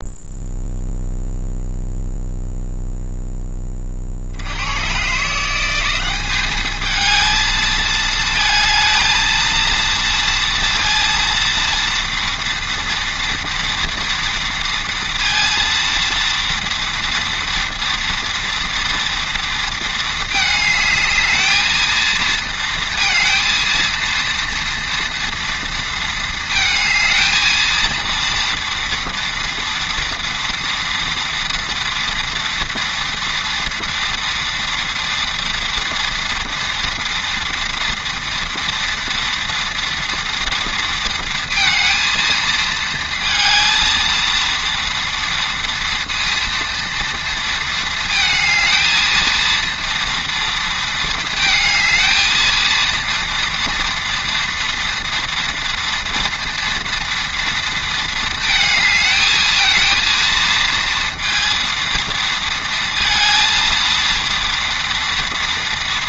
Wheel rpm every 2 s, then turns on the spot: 0, 0, 100, 210, 220, 230, 230, 230, 230, 230, 210, 220, 230, 220, 230, 230, 230, 230, 240, 230, 230, 220, 230, 230, 220, 230, 230, 230, 230, 220, 230, 230, 230.
none